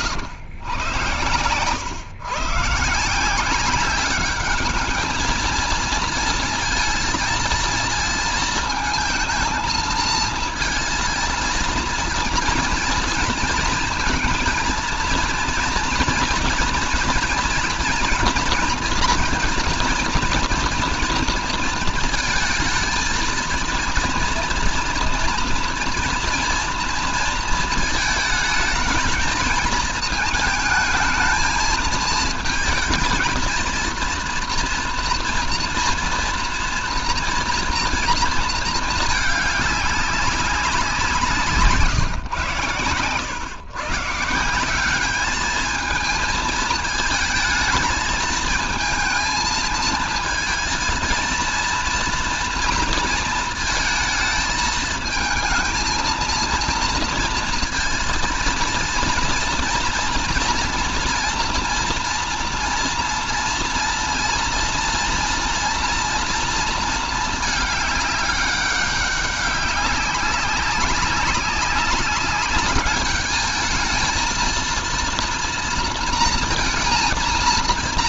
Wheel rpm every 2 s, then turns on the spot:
110, 140, 210, 220, 220, 230, 230, 230, 230, 240, 230, 220, 230, 230, 220, 220, 220, 230, 230, 220, 190, 110, 180, 220, 220, 220, 230, 220, 230, 230, 230, 230, 230, 230, 200, 190, 210, 230, 230.
none